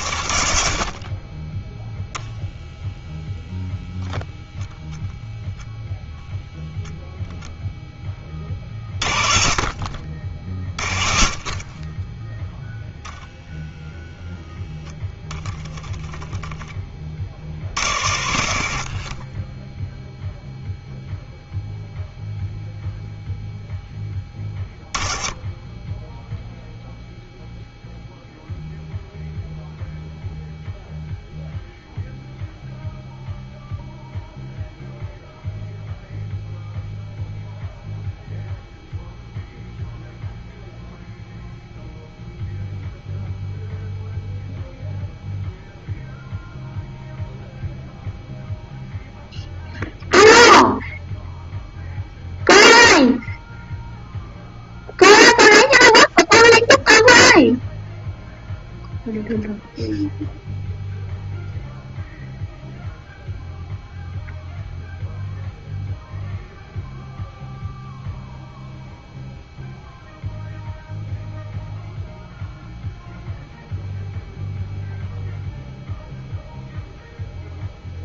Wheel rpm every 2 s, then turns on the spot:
50, 0, 10, 0, 40, 40, 0, 0, 10, 40, 0, 0, 10, 0, 0, 0, 0, 0, 0, 0, 0, 0, 0, 0, 0, 0, 0, 0, 0, 0, 0, 0, 0, 0, 0, 0, 0, 0, 0.
none